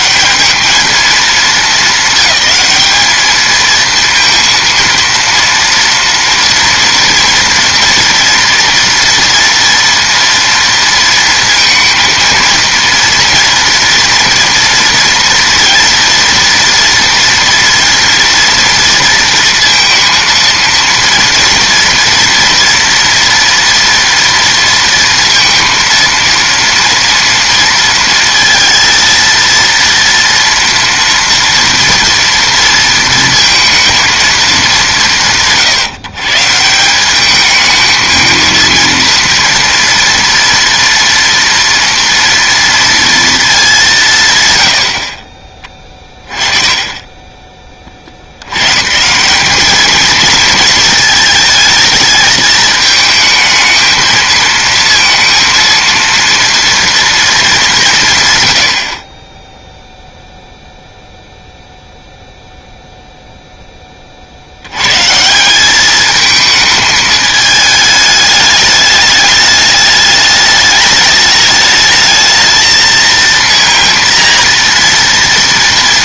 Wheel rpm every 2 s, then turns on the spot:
210, 210, 230, 240, 240, 230, 230, 230, 230, 230, 230, 230, 230, 230, 230, 230, 230, 190, 170, 230, 230, 230, 100, 30, 110, 220, 220, 230, 230, 90, 0, 0, 90, 220, 210, 210, 220, 230.
none